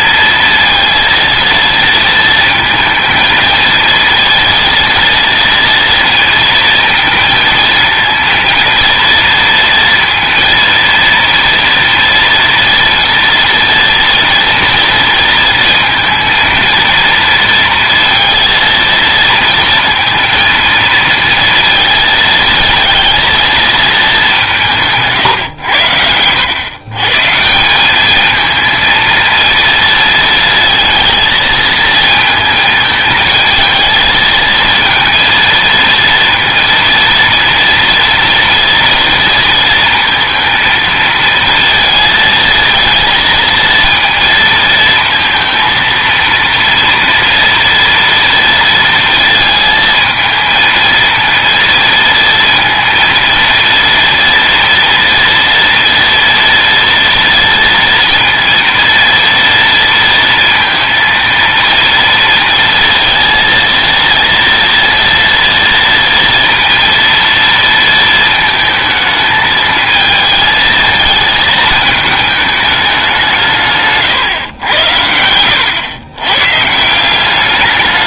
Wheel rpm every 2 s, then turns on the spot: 230, 230, 230, 230, 230, 230, 230, 230, 230, 230, 230, 230, 210, 90, 210, 230, 220, 220, 230, 230, 230, 230, 230, 230, 230, 220, 230, 230, 230, 230, 230, 230, 230, 230, 230, 220, 220, 140, 110.
none